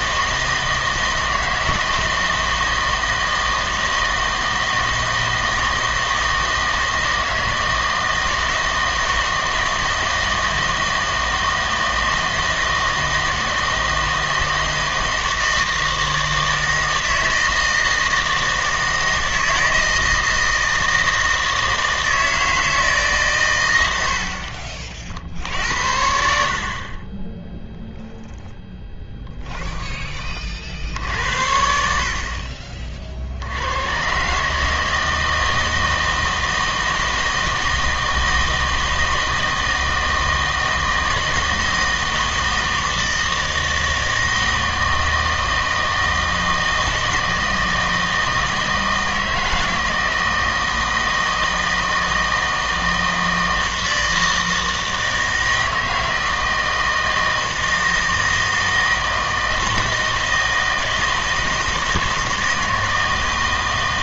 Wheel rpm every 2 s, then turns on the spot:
160, 160, 160, 160, 160, 160, 160, 160, 160, 160, 160, 160, 50, 50, 10, 50, 40, 150, 160, 160, 160, 160, 160, 160, 160, 160, 160, 160, 160, 160, 160, 160.
28-30